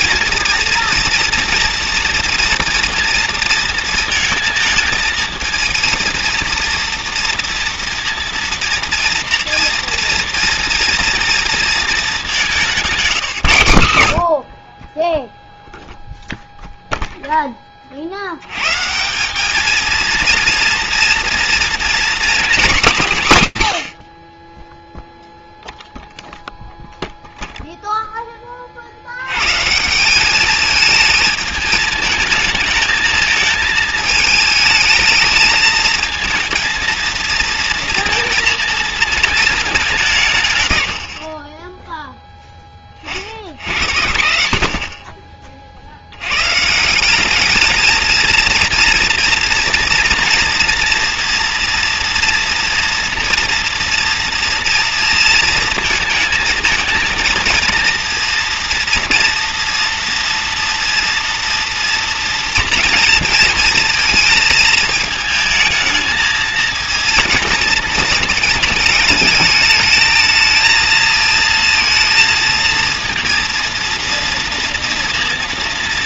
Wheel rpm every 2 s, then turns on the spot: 230, 230, 230, 230, 230, 240, 180, 40, 0, 110, 230, 240, 30, 0, 40, 210, 220, 220, 230, 230, 130, 40, 50, 170, 230, 230, 230, 230, 220, 230, 230, 230, 220, 230, 220, 230, 230, 230.
none